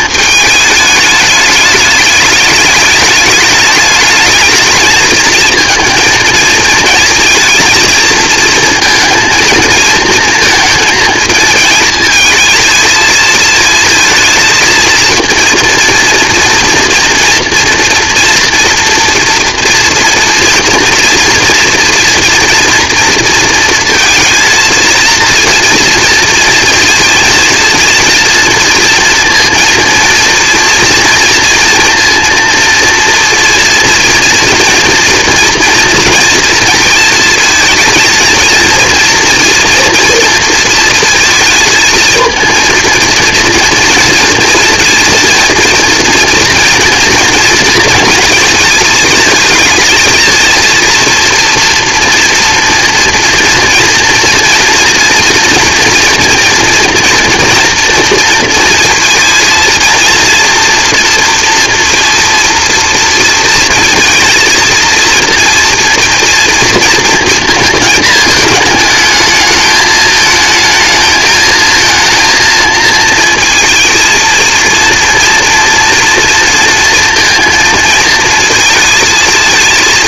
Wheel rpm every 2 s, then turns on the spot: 210, 210, 220, 230, 230, 230, 230, 230, 230, 230, 230, 230, 220, 230, 230, 230, 230, 230, 230, 230, 230, 230, 230, 230, 220, 230, 230, 230, 240, 230, 230, 230, 230, 230, 220, 220, 220, 230, 230, 230.
none